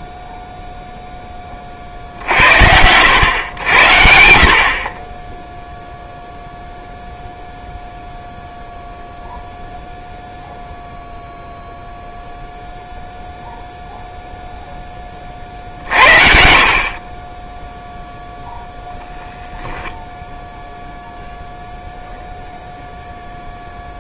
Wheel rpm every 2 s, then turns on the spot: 0, 80, 50, 0, 0, 0, 0, 0, 60, 0, 10, 0.
20-22